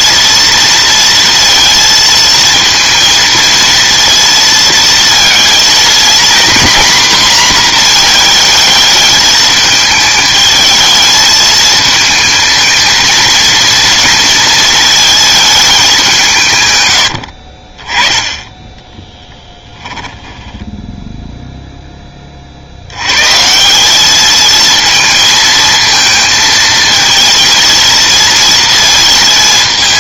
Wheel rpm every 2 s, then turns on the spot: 230, 230, 230, 250, 220, 220, 220, 220, 120, 20, 20, 80, 220, 220, 230.
18-22